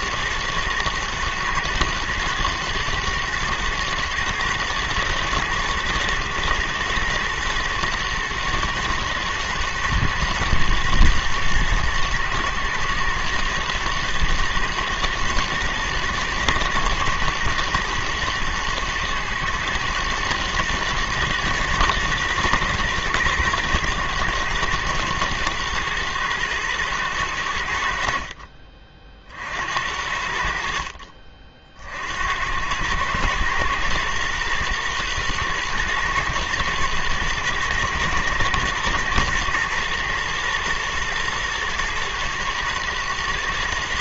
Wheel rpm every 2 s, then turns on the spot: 110, 120, 110, 110, 110, 110, 110, 110, 110, 110, 110, 110, 110, 110, 40, 70, 90, 120, 120, 110, 120, 110.
none